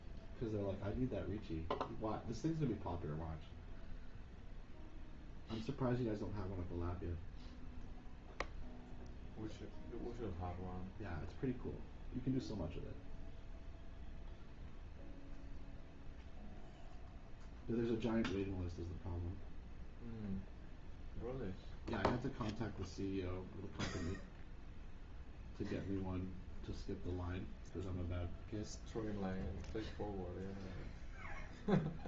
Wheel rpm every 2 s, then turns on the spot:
0, 0, 0, 0, 0, 0, 0, 0, 0, 0, 0, 0, 0, 0, 0, 0.
none